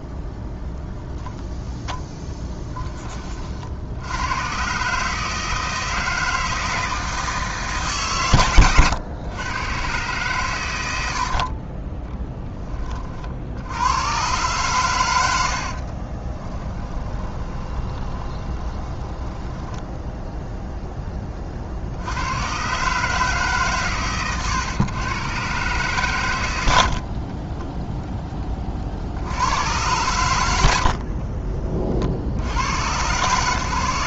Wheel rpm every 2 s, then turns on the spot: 0, 10, 130, 160, 120, 90, 20, 110, 20, 20, 0, 130, 120, 70, 50, 70, 110.
16-20 26-28 30-32